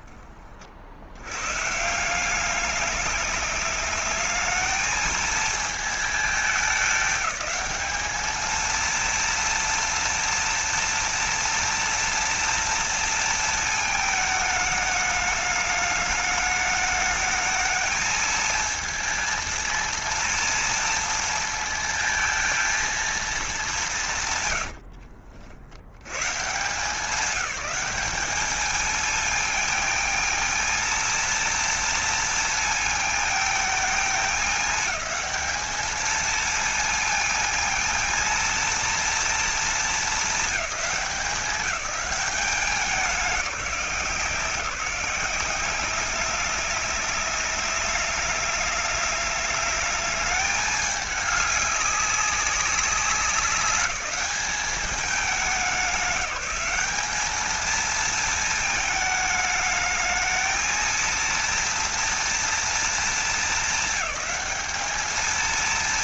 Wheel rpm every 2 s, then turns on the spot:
40, 200, 220, 210, 230, 230, 230, 220, 210, 230, 230, 230, 100, 140, 210, 230, 230, 210, 230, 230, 200, 200, 180, 200, 210, 210, 200, 200, 190, 220, 220, 230, 210.
24-26